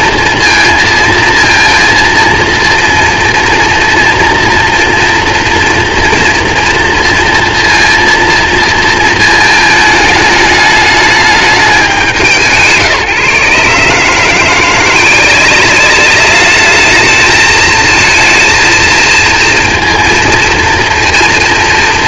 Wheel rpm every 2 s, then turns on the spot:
230, 230, 230, 230, 230, 210, 170, 160, 200, 220, 230.
none